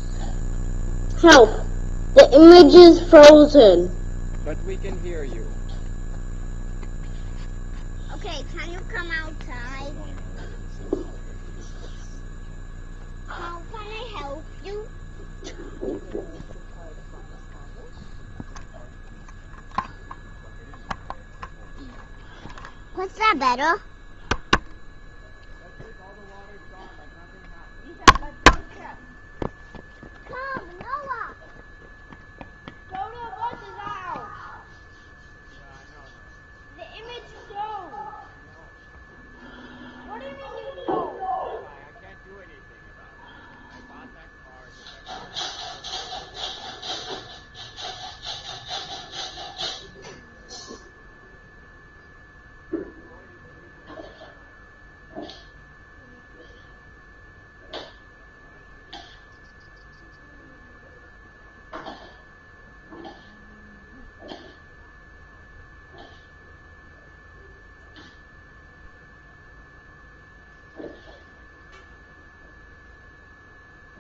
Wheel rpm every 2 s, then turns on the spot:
0, 0, 0, 0, 0, 0, 0, 0, 0, 0, 0, 0, 0, 0, 0, 0, 0, 0, 0, 0, 0, 0, 0, 0, 0, 0, 0, 0, 0, 0, 0, 0, 0, 0, 0, 0, 0.
none